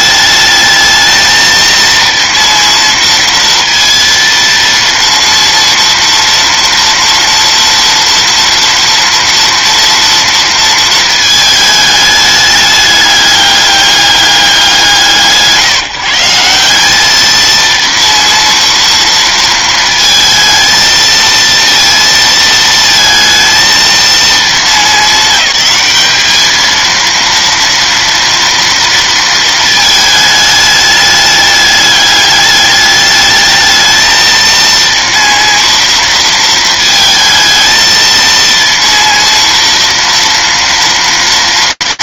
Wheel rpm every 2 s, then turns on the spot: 210, 230, 230, 230, 230, 230, 210, 200, 150, 230, 220, 230, 230, 210, 230, 220, 210, 220, 230, 220, 230.
none